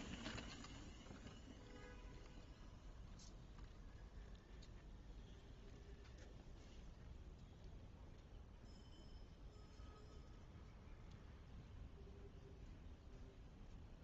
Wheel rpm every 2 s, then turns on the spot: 0, 0, 0, 0, 0, 0, 0.
none